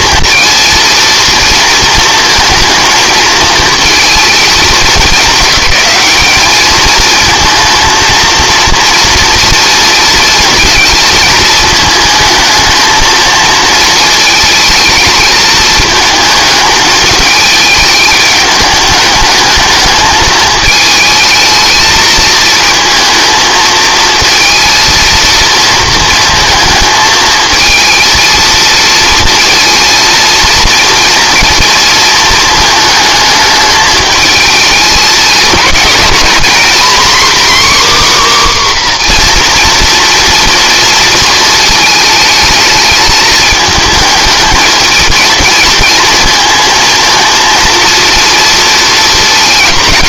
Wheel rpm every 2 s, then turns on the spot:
230, 230, 220, 220, 230, 230, 220, 220, 220, 210, 220, 230, 230, 220, 230, 230, 220, 220, 250, 270, 230, 220, 220, 230, 230.
none